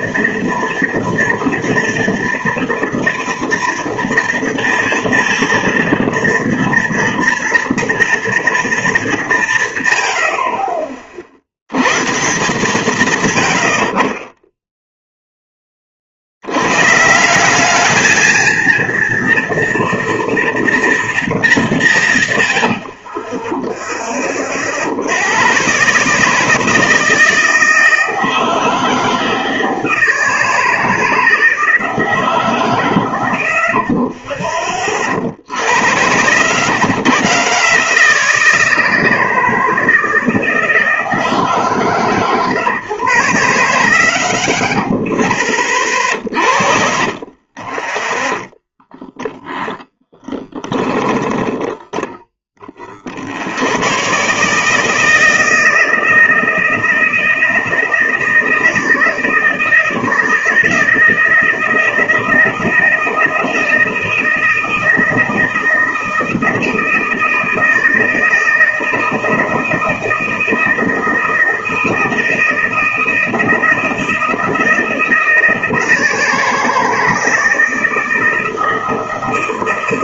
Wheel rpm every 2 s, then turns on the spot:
230, 230, 230, 230, 230, 100, 130, 50, 40, 210, 230, 170, 20, 140, 160, 160, 160, 40, 70, 160, 160, 130, 60, 50, 20, 10, 20, 100, 160, 160, 160, 160, 160, 160, 160, 160, 160, 160, 160, 160.
34-36 46-54